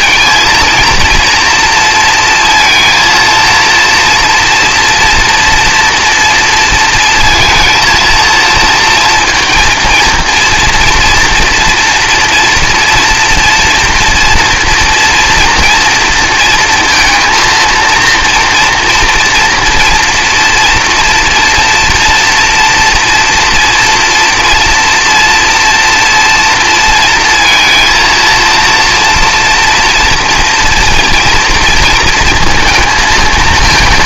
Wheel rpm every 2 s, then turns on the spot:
230, 230, 230, 230, 230, 230, 230, 230, 230, 230, 230, 230, 230, 230, 230, 240, 230.
none